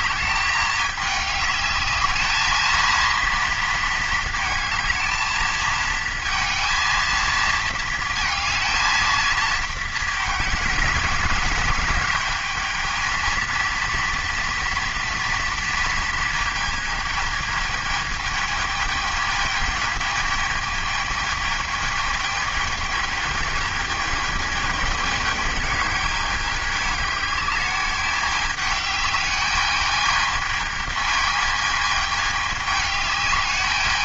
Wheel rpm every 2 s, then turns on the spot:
210, 230, 220, 230, 220, 220, 220, 230, 220, 220, 220, 220, 210, 210, 210, 220, 210.
none